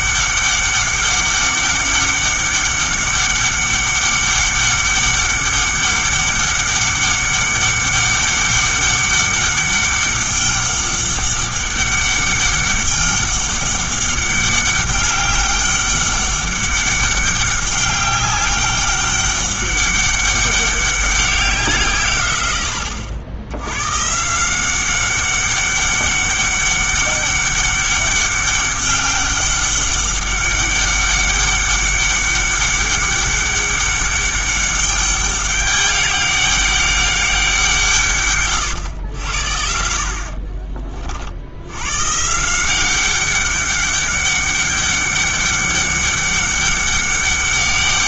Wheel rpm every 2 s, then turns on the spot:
200, 200, 200, 200, 200, 200, 200, 200, 200, 200, 200, 90, 180, 200, 200, 200, 200, 200, 200, 100, 40, 170, 200, 200.
40-42